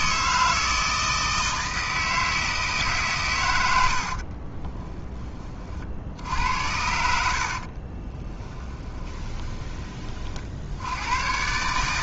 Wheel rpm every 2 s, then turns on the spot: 160, 160, 40, 70, 20, 70.
4-6 8-10